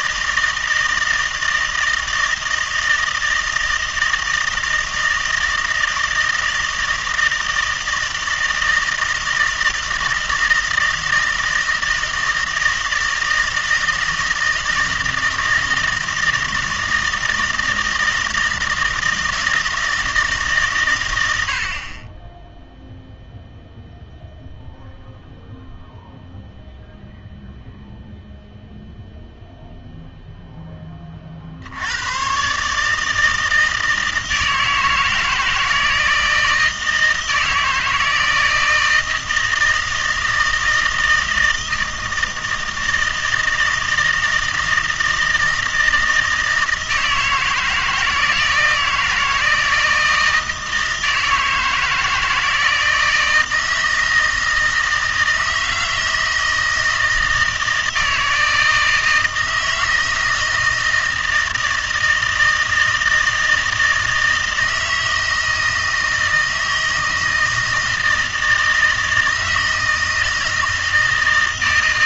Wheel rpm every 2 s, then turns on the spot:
160, 160, 160, 160, 160, 160, 160, 160, 160, 160, 140, 10, 0, 0, 0, 10, 140, 160, 160, 160, 160, 160, 160, 160, 160, 160, 160, 160, 160, 160, 160, 160, 160, 160, 160, 160.
none